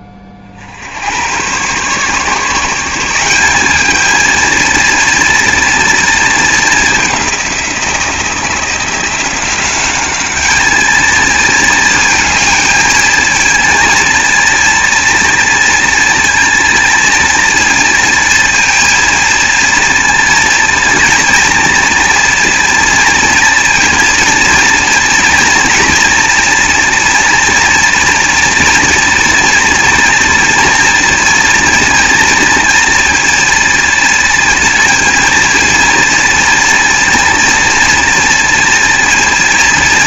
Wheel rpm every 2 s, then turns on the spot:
70, 170, 230, 210, 170, 210, 230, 230, 230, 230, 230, 230, 240, 230, 230, 230, 230, 230, 230, 230.
none